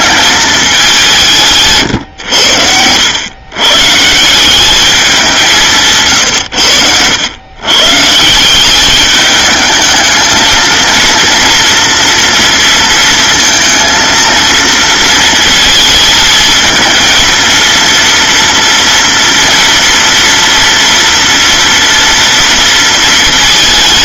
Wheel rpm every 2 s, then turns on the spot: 180, 100, 200, 100, 210, 230, 230, 230, 230, 230, 230, 230.
none